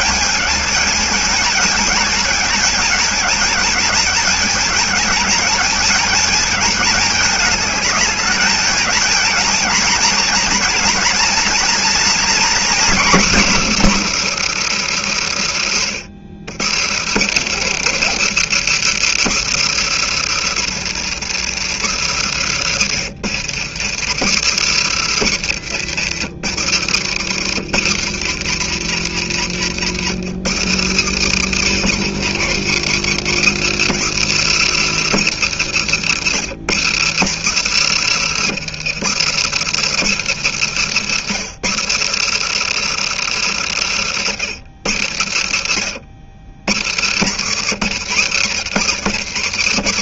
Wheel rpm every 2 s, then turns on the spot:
220, 220, 220, 210, 220, 230, 240, 190, 120, 200, 150, 140, 150, 130, 130, 130, 150, 170, 140, 150, 160, 170, 130, 90, 130.
none